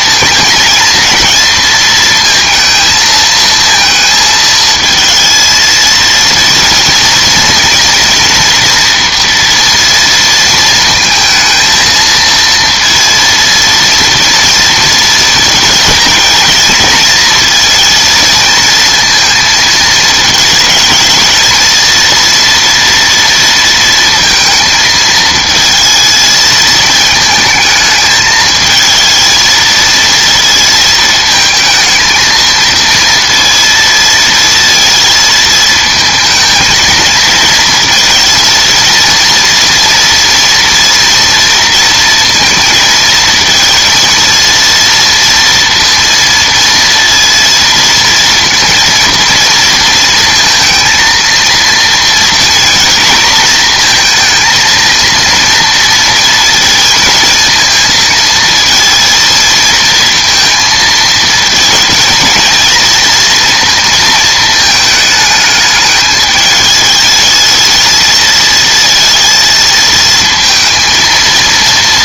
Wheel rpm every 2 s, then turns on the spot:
230, 220, 230, 230, 230, 230, 230, 230, 230, 230, 220, 230, 220, 220, 220, 230, 230, 230, 220, 230, 230, 230, 230, 230, 230, 230, 230, 230, 230, 230, 230, 230, 220, 210, 220, 230.
none